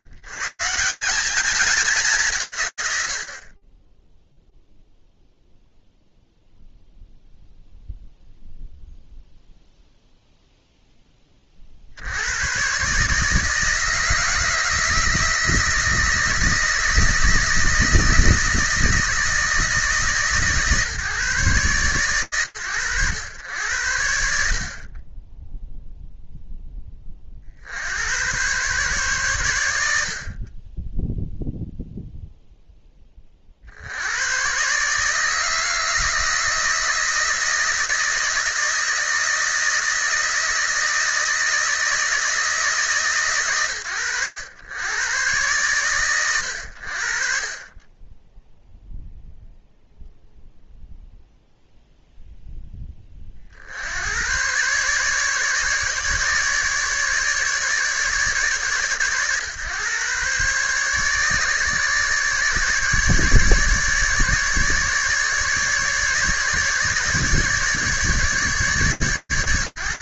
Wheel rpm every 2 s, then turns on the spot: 120, 170, 0, 0, 0, 10, 130, 160, 160, 170, 140, 110, 20, 20, 130, 10, 30, 150, 160, 160, 160, 130, 110, 50, 0, 0, 40, 150, 150, 140, 150, 150, 150, 150, 110.
none